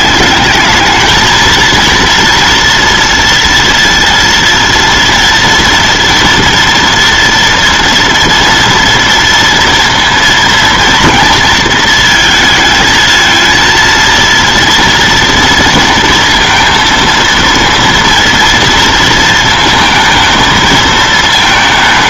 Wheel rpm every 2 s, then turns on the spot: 210, 240, 230, 230, 230, 230, 220, 230, 230, 230, 220.
none